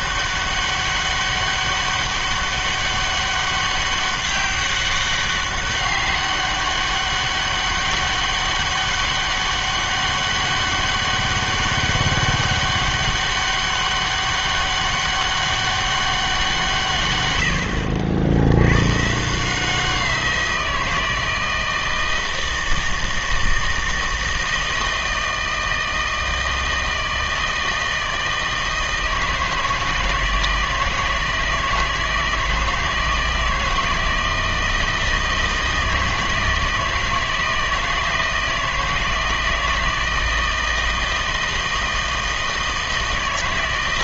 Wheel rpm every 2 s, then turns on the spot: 200, 200, 200, 200, 200, 200, 200, 200, 160, 100, 170, 160, 160, 160, 160, 160, 160, 160, 160, 160, 160, 160.
none